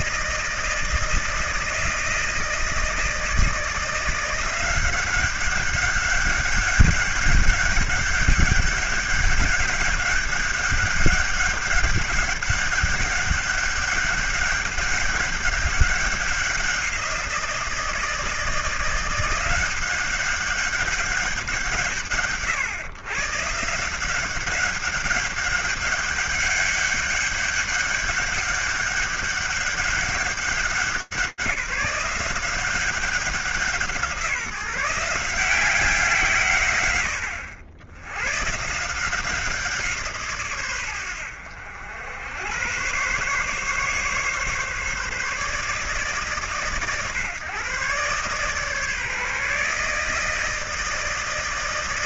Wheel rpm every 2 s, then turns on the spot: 160, 160, 180, 200, 200, 200, 200, 200, 190, 170, 190, 120, 190, 200, 200, 190, 180, 170, 110, 160, 110, 120, 150, 140, 150, 160.
none